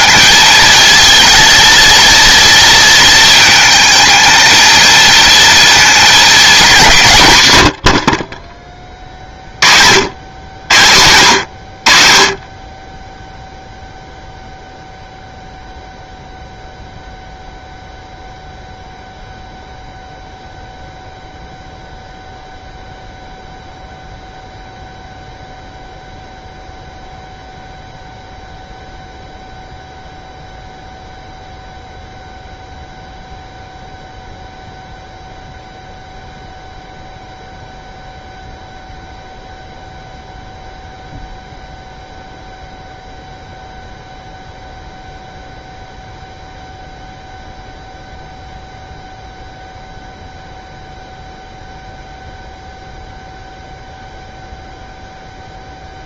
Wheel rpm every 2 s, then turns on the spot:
230, 230, 230, 220, 30, 100, 20, 0, 0, 0, 0, 0, 0, 0, 0, 0, 0, 0, 0, 0, 0, 0, 0, 0, 0, 0, 0, 0.
none